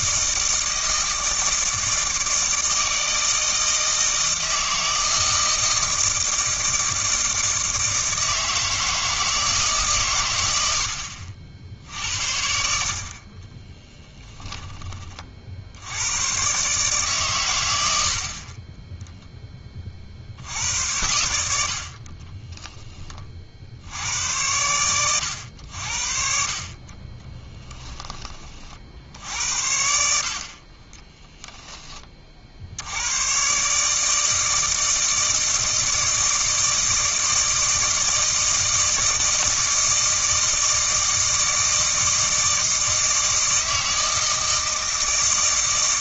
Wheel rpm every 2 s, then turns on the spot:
160, 160, 160, 160, 160, 80, 60, 20, 140, 10, 90, 10, 100, 40, 50, 30, 80, 160, 160, 160, 160, 160, 160.
30-32